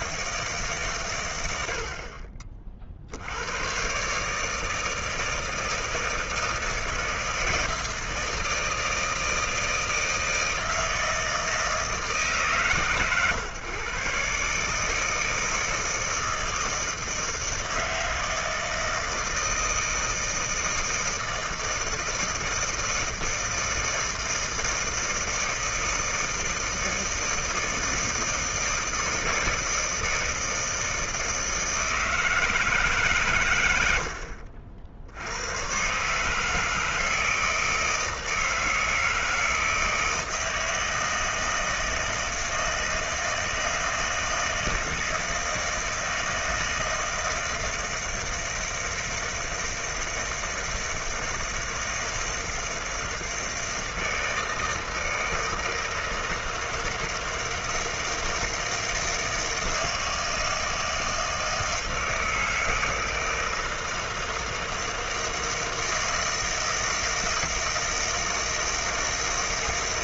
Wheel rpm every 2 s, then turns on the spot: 100, 80, 160, 160, 160, 160, 130, 160, 160, 160, 160, 160, 160, 160, 160, 160, 90, 130, 160, 160, 160, 160, 160, 160, 160, 160, 160, 160, 160, 160, 160, 160, 160, 160, 160.
none